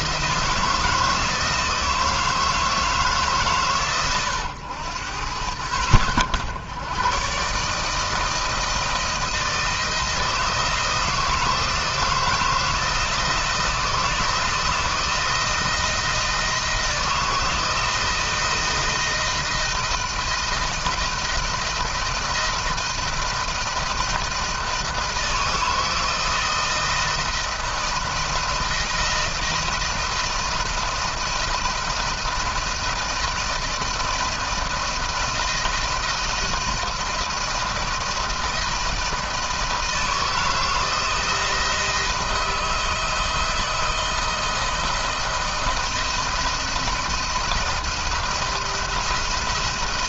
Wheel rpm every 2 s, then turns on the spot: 160, 160, 90, 110, 160, 160, 170, 170, 160, 160, 160, 170, 160, 160, 160, 170, 170, 160, 170, 170, 160, 160, 170, 170, 170.
none